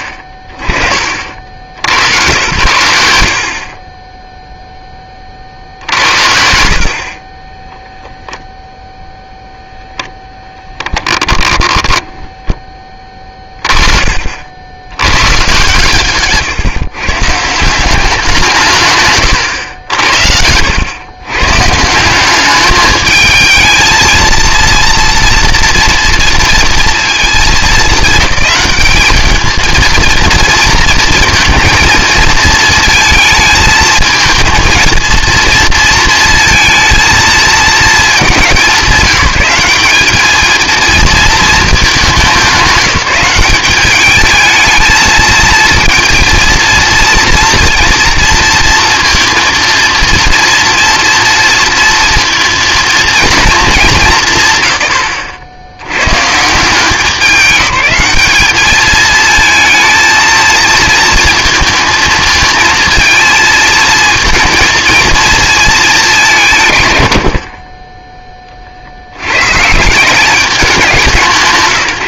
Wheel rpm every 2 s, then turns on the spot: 30, 90, 10, 50, 0, 10, 20, 80, 140, 140, 100, 210, 230, 230, 210, 230, 230, 230, 230, 190, 230, 180, 220, 230, 230, 230, 230, 140, 160, 210, 220, 220, 230, 130, 40, 180.
10-12